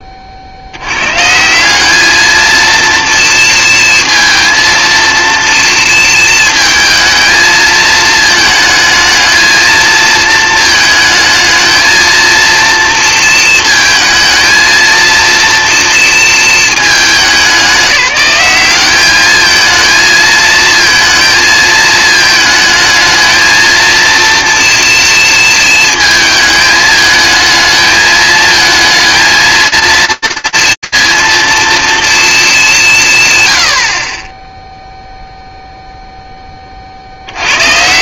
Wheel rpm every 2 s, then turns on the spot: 80, 230, 230, 220, 220, 220, 230, 230, 210, 200, 230, 220, 230, 220, 220, 230, 200, 0, 40.
none